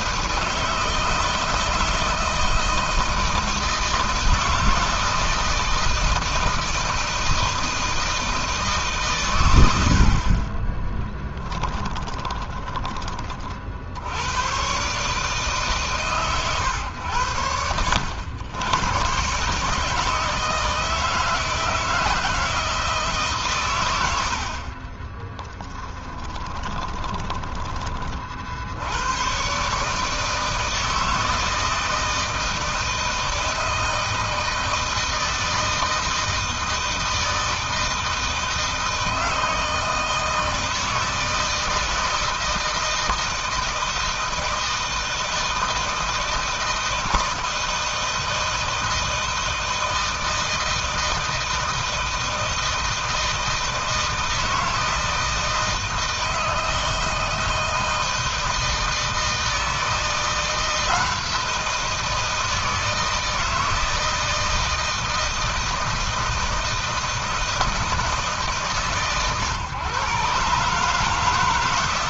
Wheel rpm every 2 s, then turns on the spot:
160, 160, 160, 160, 150, 30, 20, 120, 120, 100, 160, 160, 60, 20, 70, 160, 160, 160, 160, 160, 160, 160, 160, 160, 160, 160, 160, 160, 160, 160, 170, 160, 160, 160, 140, 140.
10-14 24-28